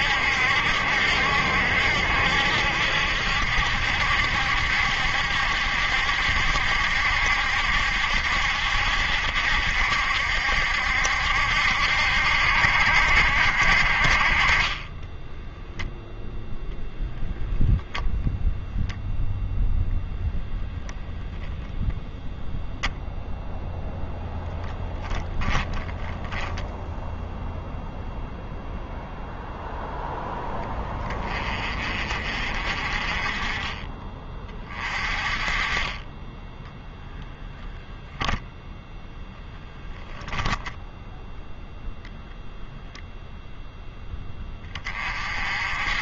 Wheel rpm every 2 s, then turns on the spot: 70, 70, 70, 70, 70, 70, 70, 20, 0, 0, 0, 0, 10, 0, 0, 20, 40, 30, 10, 0, 0, 0, 20.
14-16